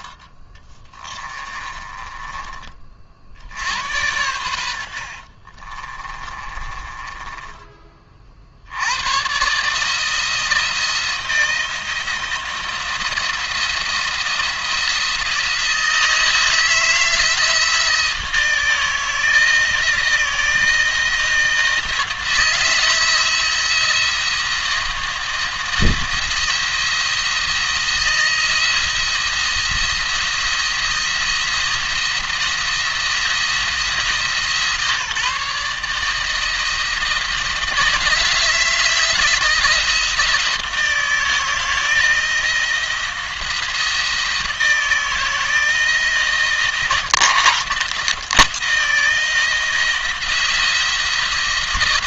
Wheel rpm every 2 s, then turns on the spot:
20, 40, 80, 20, 70, 160, 160, 170, 160, 160, 160, 160, 170, 170, 170, 170, 170, 150, 160, 160, 160, 160, 170, 170, 170, 170.
0-2 4-8